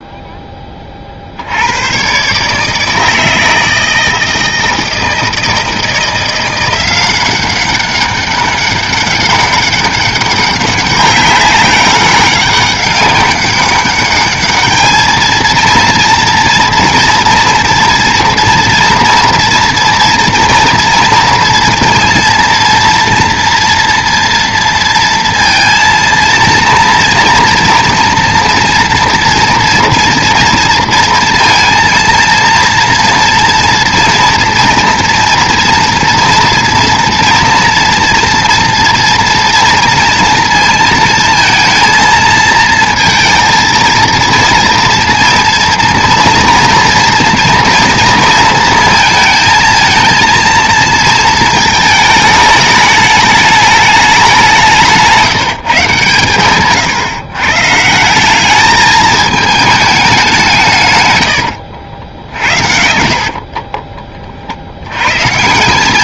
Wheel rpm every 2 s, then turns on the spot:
10, 150, 160, 180, 200, 200, 200, 210, 240, 230, 240, 230, 230, 230, 230, 230, 230, 230, 230, 230, 230, 230, 230, 230, 220, 230, 210, 180, 130, 210, 180, 60, 70.
none